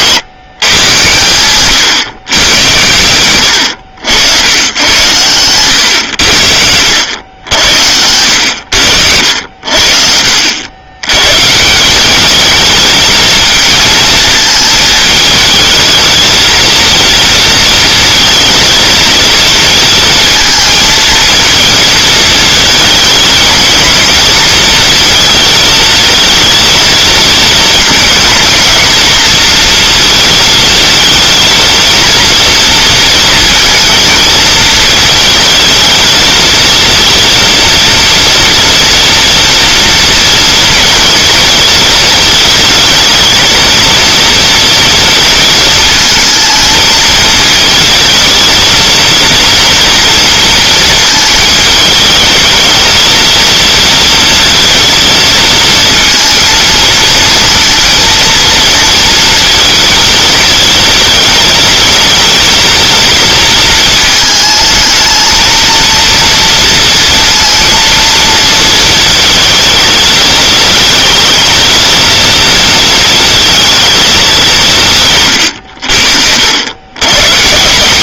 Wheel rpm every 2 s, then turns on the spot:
100, 100, 90, 80, 90, 100, 220, 220, 230, 230, 230, 220, 230, 230, 240, 220, 230, 220, 230, 230, 230, 230, 230, 220, 230, 230, 220, 230, 230, 230, 220, 230, 220, 230, 230, 220, 230, 150, 110.
none